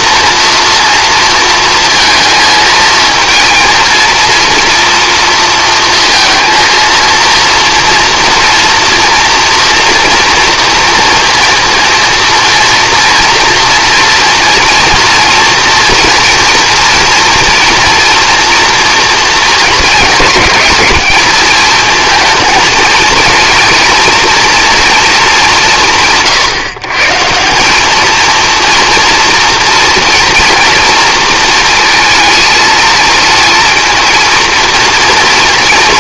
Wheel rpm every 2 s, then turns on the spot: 230, 230, 230, 230, 230, 230, 230, 230, 230, 240, 220, 230, 230, 130, 230, 230, 220, 230.
none